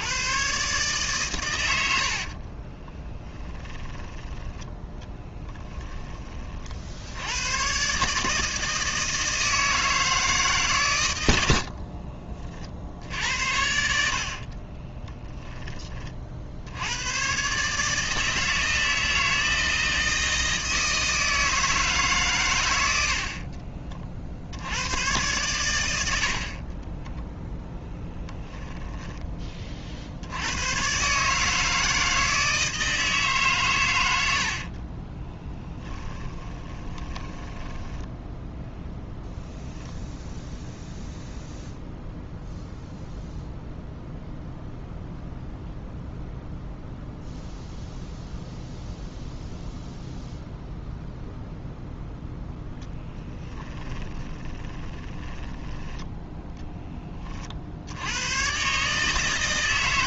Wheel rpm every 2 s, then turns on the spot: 140, 20, 10, 60, 160, 120, 60, 30, 80, 160, 160, 100, 90, 30, 10, 120, 160, 30, 20, 0, 0, 0, 0, 0, 0, 0, 10, 20, 10, 140.
2-4 14-16 26-28 34-38 52-56